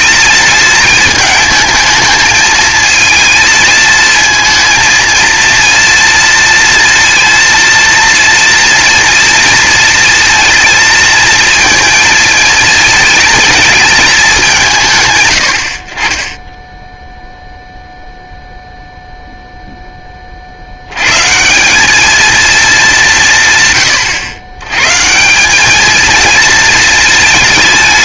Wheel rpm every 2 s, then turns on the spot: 220, 220, 230, 230, 240, 230, 230, 160, 0, 0, 100, 200, 130, 220.
none